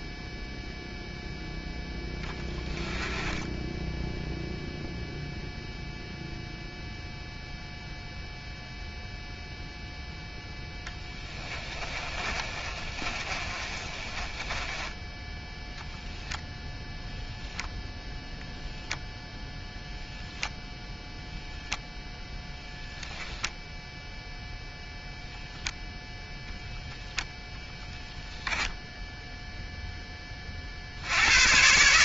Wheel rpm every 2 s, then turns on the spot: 0, 10, 0, 0, 0, 10, 30, 10, 0, 0, 0, 10, 0, 0, 10, 40.
2-4 12-16